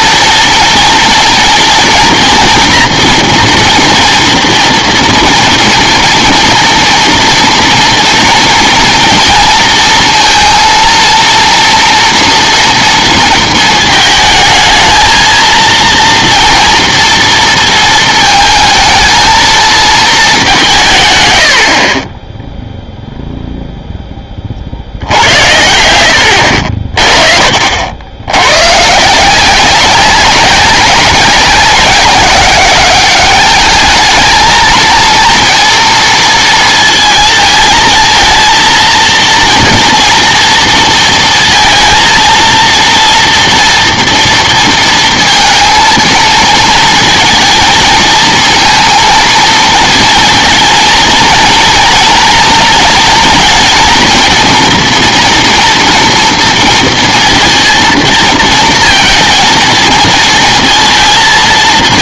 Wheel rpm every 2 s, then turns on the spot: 230, 230, 240, 230, 230, 230, 230, 220, 230, 230, 170, 0, 50, 60, 120, 190, 190, 230, 230, 230, 230, 230, 230, 230, 230, 230, 230, 230, 230, 230, 230.
none